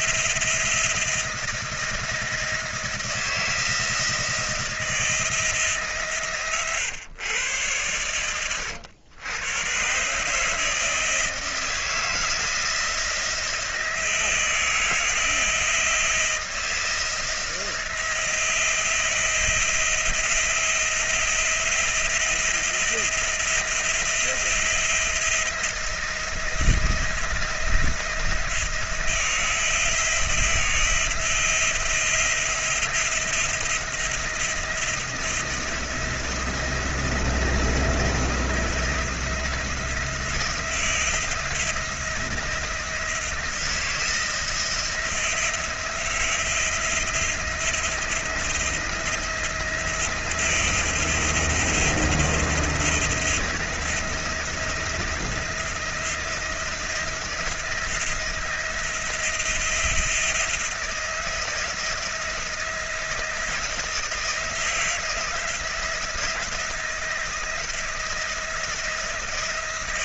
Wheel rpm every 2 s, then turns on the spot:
170, 170, 170, 150, 110, 140, 160, 170, 170, 170, 170, 170, 160, 170, 170, 160, 170, 170, 170, 170, 170, 170, 160, 160, 170, 170, 170, 160, 170, 170, 170, 160, 160, 170, 170.
8-10